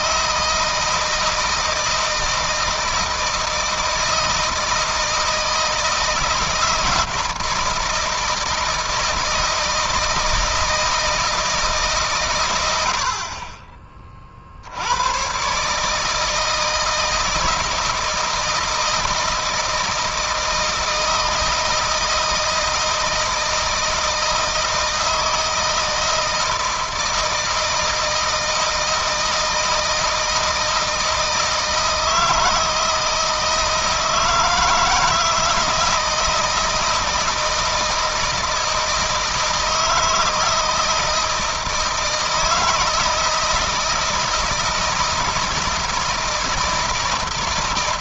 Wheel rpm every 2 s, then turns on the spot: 160, 160, 160, 160, 160, 160, 100, 70, 160, 160, 160, 160, 160, 160, 160, 160, 160, 160, 160, 160, 160, 160, 160, 160.
none